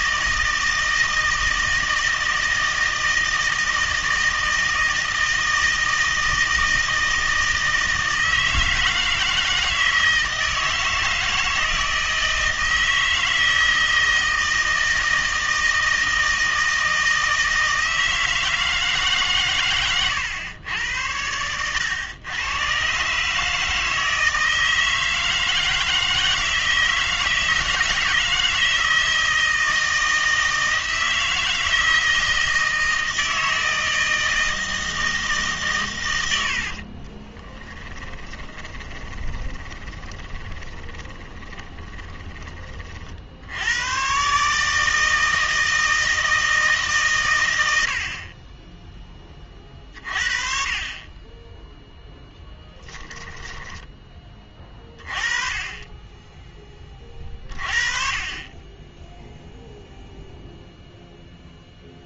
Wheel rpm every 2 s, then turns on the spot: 160, 160, 160, 160, 160, 160, 160, 160, 160, 160, 110, 120, 160, 160, 160, 160, 160, 160, 60, 20, 20, 20, 150, 160, 20, 40, 10, 30, 20, 20, 0.
36-42